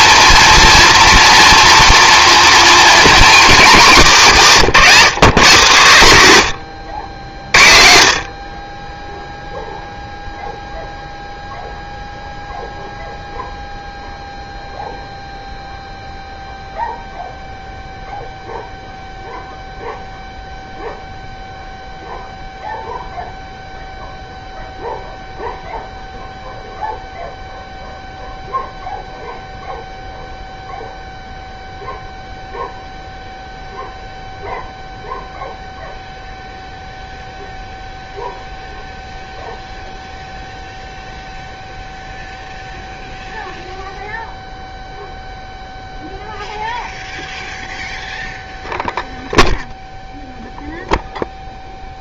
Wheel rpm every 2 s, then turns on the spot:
230, 230, 190, 90, 30, 0, 0, 0, 0, 0, 0, 0, 0, 0, 0, 0, 0, 0, 0, 0, 0, 0, 0, 0, 0, 0.
none